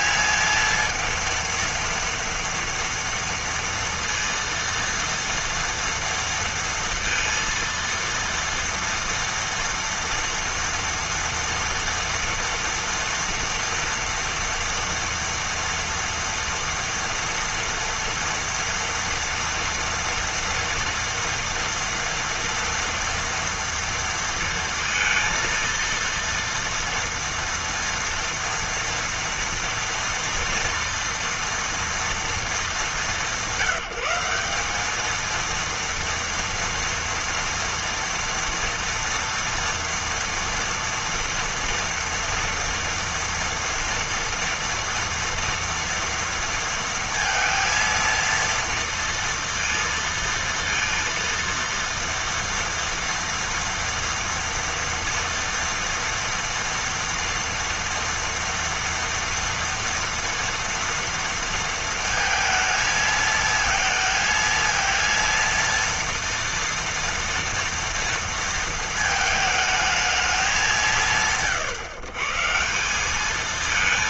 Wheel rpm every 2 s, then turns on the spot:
230, 230, 230, 230, 230, 230, 230, 230, 230, 230, 230, 230, 230, 230, 240, 230, 200, 200, 230, 240, 230, 230, 240, 230, 230, 230, 230, 230, 230, 230, 230, 220, 230, 230, 230, 120, 170.
none